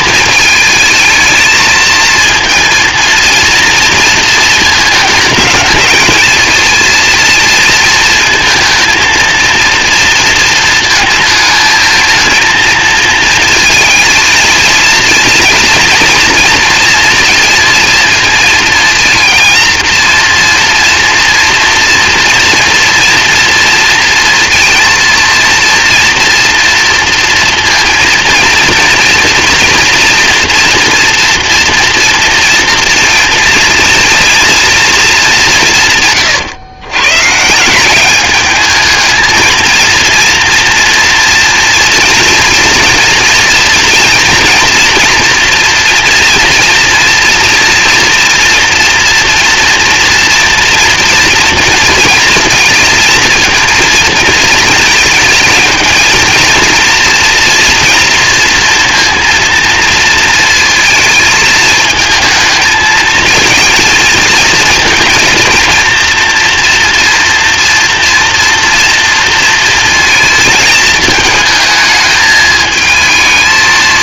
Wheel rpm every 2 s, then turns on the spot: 220, 230, 220, 230, 220, 230, 220, 230, 230, 230, 230, 230, 230, 230, 230, 230, 230, 230, 120, 210, 230, 240, 230, 230, 240, 230, 230, 220, 230, 230, 230, 220, 230, 230, 230, 220, 220.
none